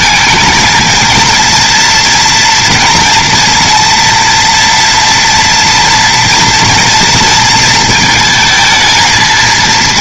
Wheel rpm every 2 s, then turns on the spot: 230, 230, 240, 230, 220.
none